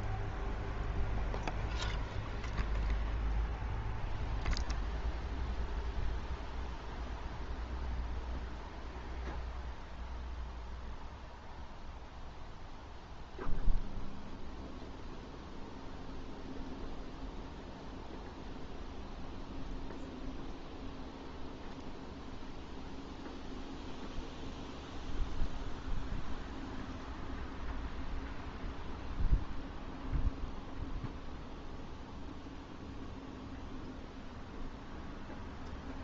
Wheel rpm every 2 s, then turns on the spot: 0, 0, 0, 0, 0, 0, 0, 0, 0, 0, 0, 0, 0, 0, 0, 0, 0, 0.
none